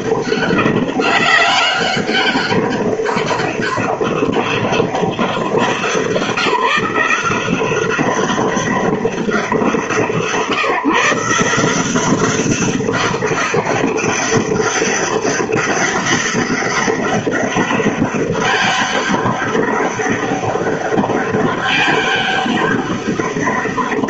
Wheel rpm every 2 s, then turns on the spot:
200, 200, 200, 180, 200, 150, 200, 200, 200, 200, 200, 200.
none